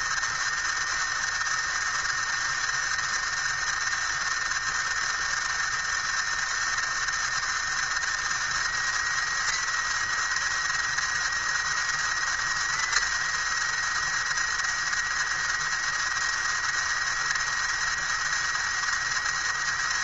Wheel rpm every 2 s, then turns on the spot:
110, 110, 110, 110, 110, 110, 110, 110, 110, 110.
none